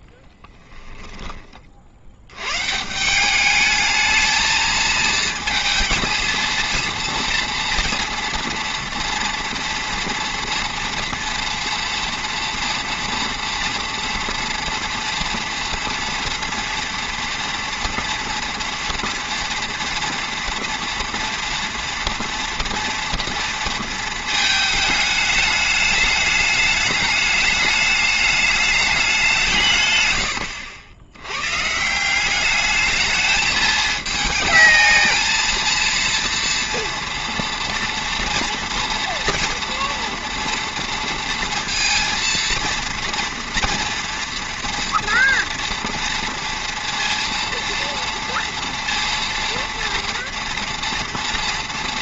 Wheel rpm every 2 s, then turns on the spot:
20, 130, 220, 220, 230, 240, 230, 240, 230, 230, 230, 230, 220, 210, 210, 90, 210, 220, 230, 230, 230, 230, 240, 230, 230, 230.
0-2